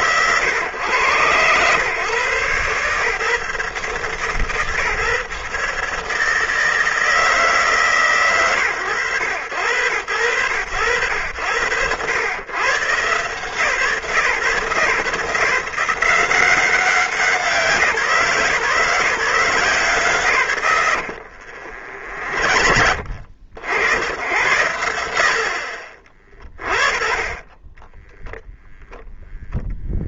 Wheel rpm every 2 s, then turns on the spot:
120, 130, 150, 150, 130, 80, 100, 120, 180, 150, 130, 50, 110, 30, 0.
none